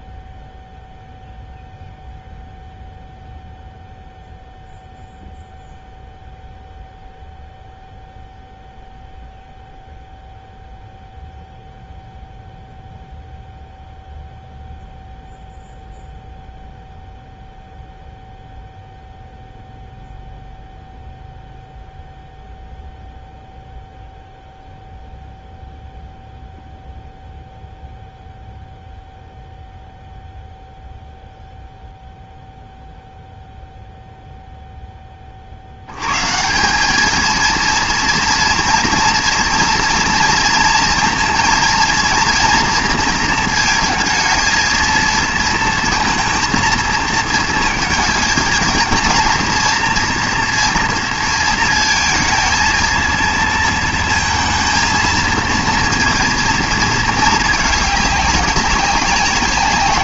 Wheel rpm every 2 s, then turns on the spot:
0, 0, 0, 0, 0, 0, 0, 0, 0, 0, 0, 0, 0, 0, 0, 0, 0, 0, 160, 230, 230, 230, 220, 230, 230, 230, 230, 230, 230, 200.
none